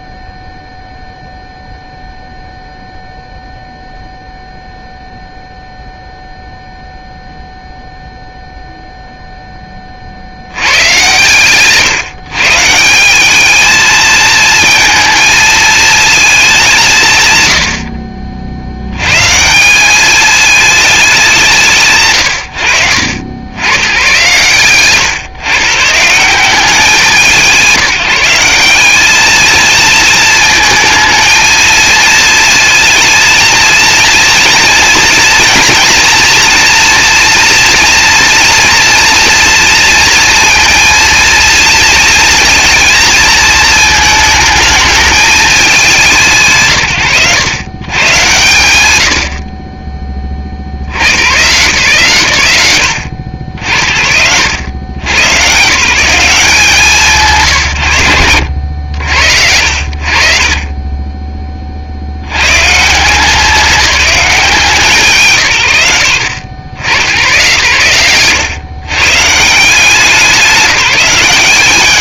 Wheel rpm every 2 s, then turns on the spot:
0, 0, 0, 0, 0, 130, 180, 220, 180, 90, 210, 90, 130, 180, 190, 220, 230, 230, 230, 230, 230, 230, 220, 80, 100, 60, 120, 110, 150, 80, 30, 130, 160, 110, 120, 190.
none